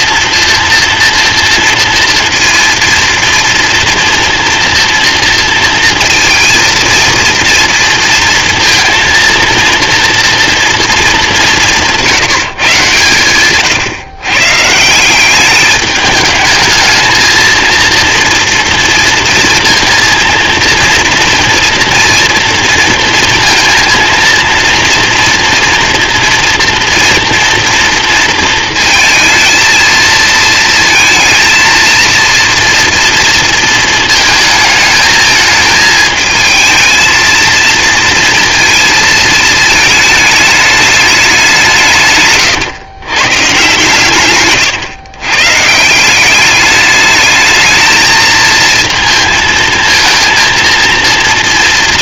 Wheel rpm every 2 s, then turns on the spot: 240, 230, 230, 230, 230, 230, 150, 140, 220, 230, 230, 230, 230, 230, 220, 220, 230, 220, 220, 230, 210, 130, 130, 200, 220, 230.
44-46